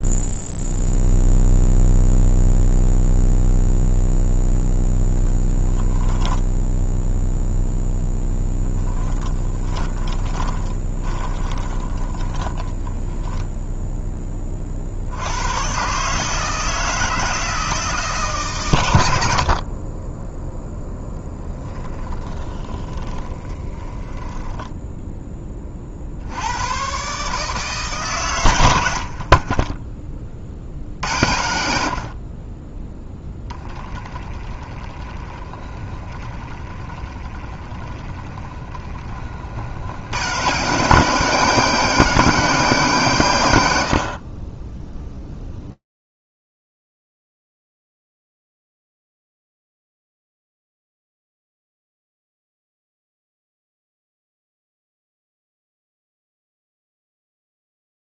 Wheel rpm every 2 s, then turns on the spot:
0, 0, 0, 0, 20, 20, 20, 40, 160, 120, 0, 40, 10, 100, 100, 50, 20, 20, 20, 20, 130, 160, 20, 0, 0, 0, 0, 0, 0.
8-14 22-26 34-40